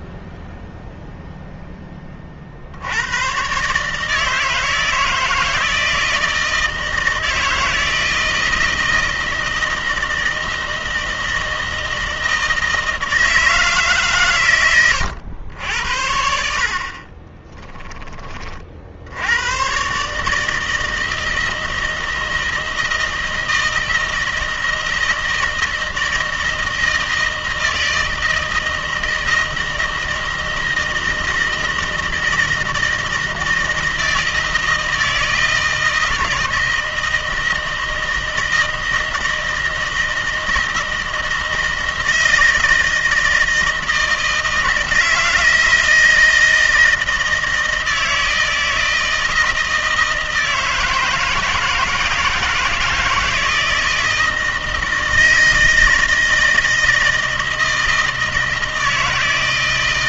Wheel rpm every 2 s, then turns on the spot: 0, 80, 160, 160, 160, 160, 160, 100, 50, 60, 160, 160, 170, 160, 160, 160, 160, 160, 160, 160, 160, 160, 160, 160, 160, 160, 160, 160, 160, 160.
16-18